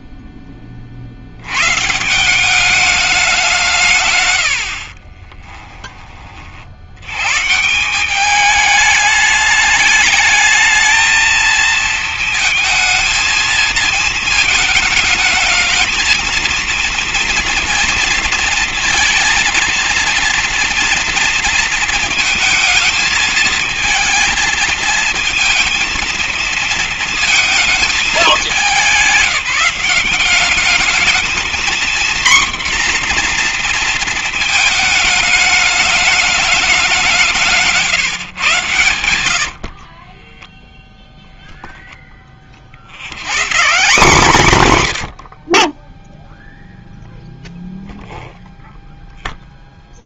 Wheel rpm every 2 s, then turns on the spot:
30, 180, 90, 60, 210, 220, 220, 220, 230, 230, 230, 220, 220, 230, 200, 200, 240, 230, 200, 120, 10, 40, 170, 0, 0.
4-6 40-42